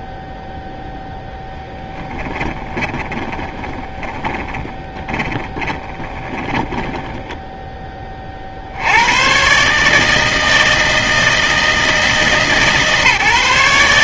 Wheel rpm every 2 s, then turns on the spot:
0, 20, 30, 30, 50, 160, 160.
2-8